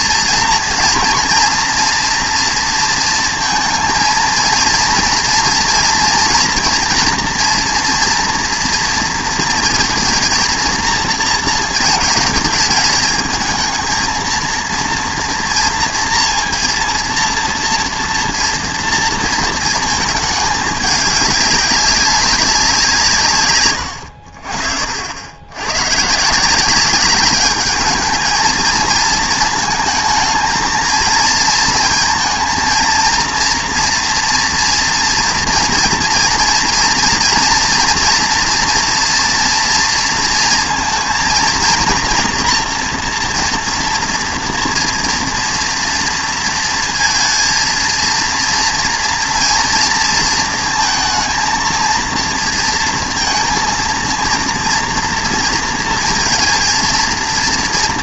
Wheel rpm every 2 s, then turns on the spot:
230, 230, 230, 230, 230, 230, 220, 230, 230, 230, 210, 190, 60, 190, 220, 230, 230, 230, 230, 230, 230, 240, 230, 230, 230, 230, 230, 230, 230.
none